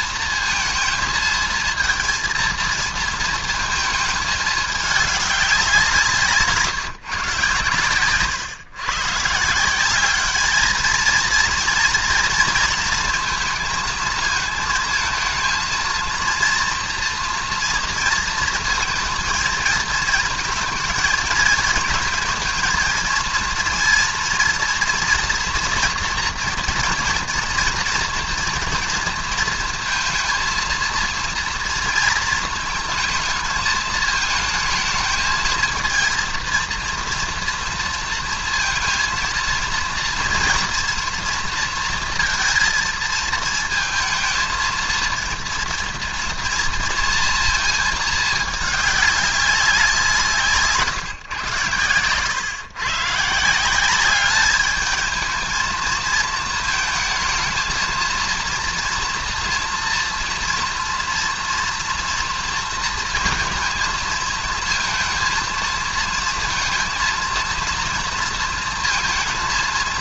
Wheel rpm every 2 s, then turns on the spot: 230, 230, 220, 160, 120, 200, 230, 220, 230, 230, 220, 220, 230, 240, 230, 220, 230, 220, 230, 230, 230, 230, 220, 230, 220, 170, 120, 200, 230, 230, 230, 230, 230, 230, 230.
none